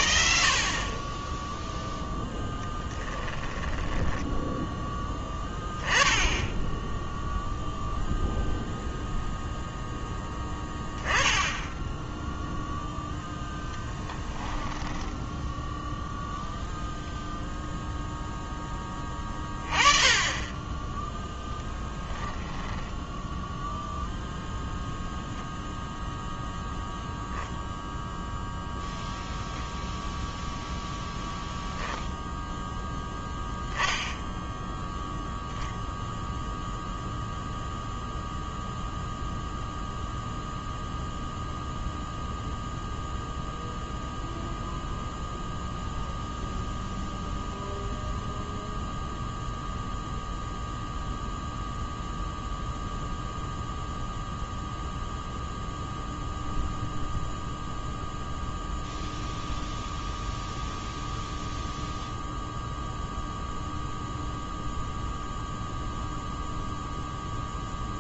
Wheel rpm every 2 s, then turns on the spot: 50, 10, 10, 10, 0, 10, 0, 10, 0, 10, 20, 10, 0, 0, 0, 0, 0, 0, 0, 0, 0, 0, 0, 0, 0, 0, 0, 0, 0, 0, 0, 0, 0, 0.
2-4 14-16 22-24